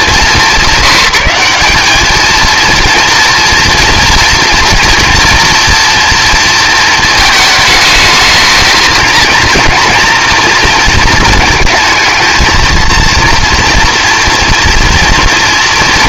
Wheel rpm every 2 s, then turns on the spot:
170, 230, 240, 230, 220, 230, 230, 240.
none